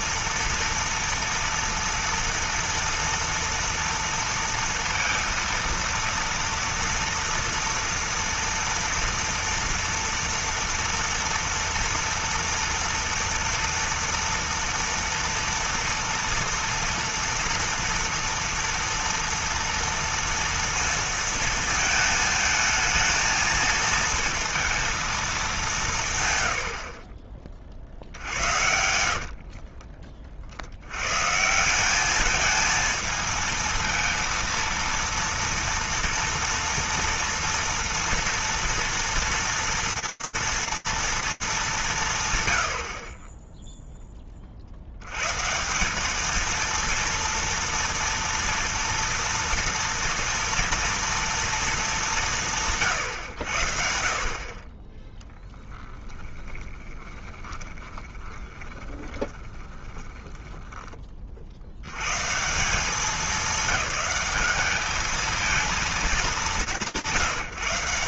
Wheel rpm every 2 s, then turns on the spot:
230, 230, 230, 230, 230, 230, 230, 240, 240, 230, 230, 220, 230, 110, 70, 70, 210, 230, 230, 240, 230, 90, 40, 220, 240, 240, 170, 30, 20, 20, 10, 170, 210, 180.
28-30 56-60